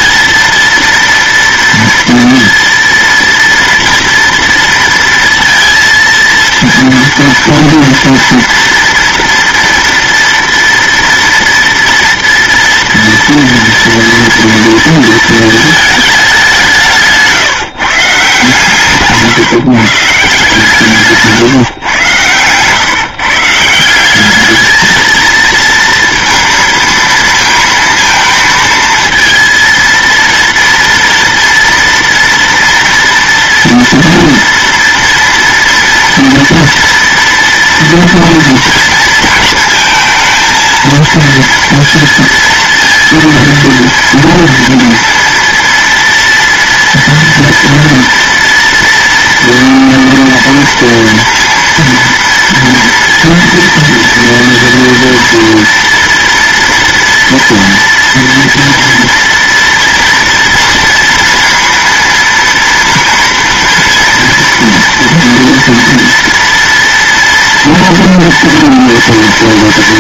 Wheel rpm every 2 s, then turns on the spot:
230, 230, 230, 230, 230, 230, 230, 230, 180, 150, 160, 130, 220, 230, 230, 230, 230, 230, 230, 230, 230, 230, 230, 230, 230, 230, 230, 230, 230, 230, 230, 230, 230, 230, 230.
none